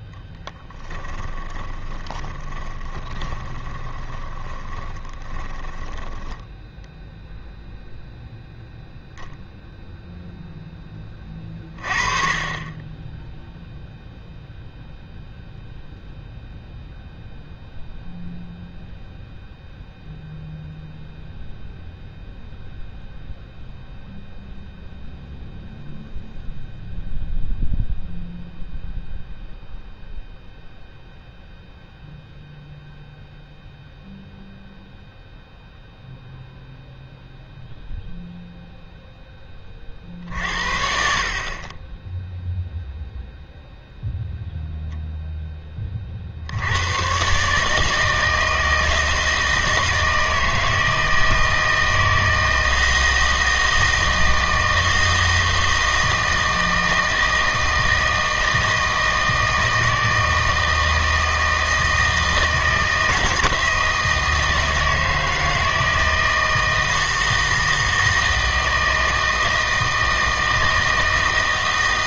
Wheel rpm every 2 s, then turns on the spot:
20, 20, 20, 10, 0, 10, 30, 0, 0, 0, 0, 0, 0, 0, 0, 0, 0, 0, 0, 0, 60, 0, 0, 80, 160, 160, 160, 160, 160, 160, 160, 160, 160, 160, 160, 160.
0-8